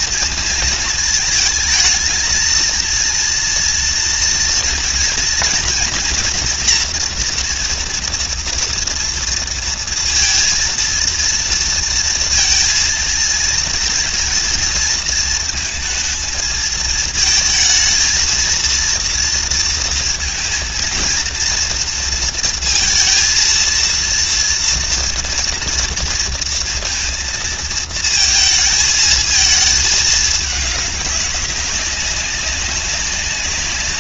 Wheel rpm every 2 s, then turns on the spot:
220, 230, 230, 240, 230, 230, 230, 230, 220, 230, 230, 230, 230, 230, 220, 210, 190.
none